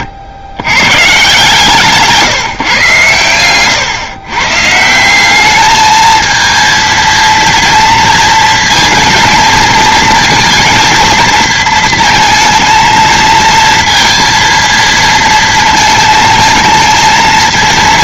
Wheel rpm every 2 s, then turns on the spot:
120, 140, 150, 230, 230, 230, 230, 230, 220.
none